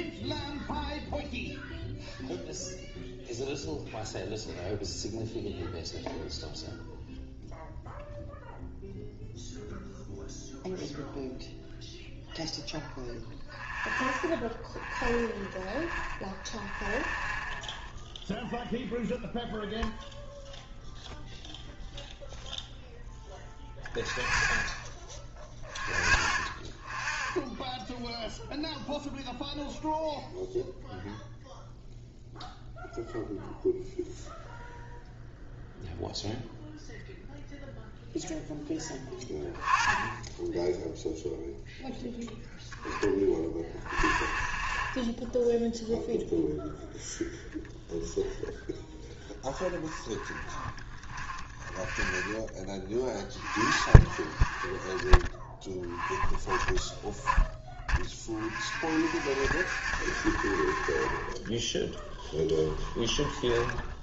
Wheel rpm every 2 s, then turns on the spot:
0, 0, 0, 0, 0, 0, 0, 0, 0, 0, 0, 0, 0, 0, 0, 0, 0, 0, 0, 10, 10, 0, 0, 0, 0, 20, 10, 30, 10, 40, 50, 10.
50-52 62-64